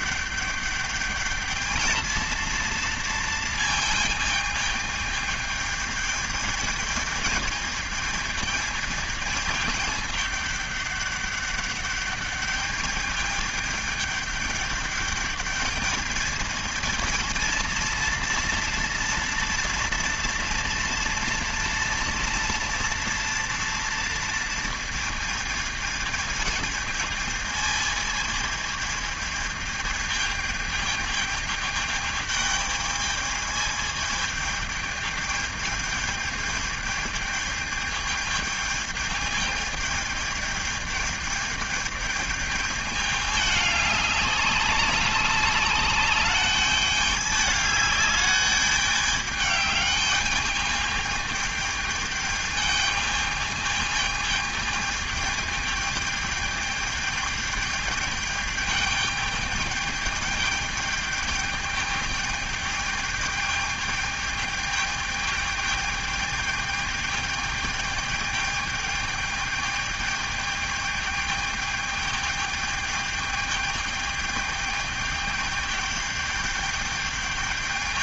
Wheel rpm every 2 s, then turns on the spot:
210, 230, 220, 220, 220, 210, 210, 210, 220, 230, 230, 230, 230, 220, 220, 220, 210, 220, 220, 220, 220, 210, 200, 200, 210, 210, 210, 210, 210, 210, 210, 210, 210, 210, 210, 210, 210, 210, 210.
none